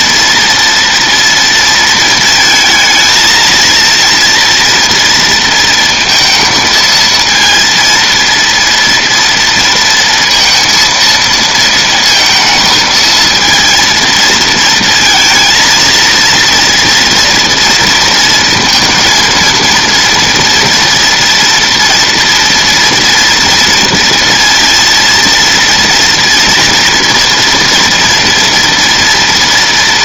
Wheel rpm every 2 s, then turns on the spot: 230, 220, 230, 230, 230, 230, 230, 230, 230, 230, 230, 230, 230, 230, 230.
none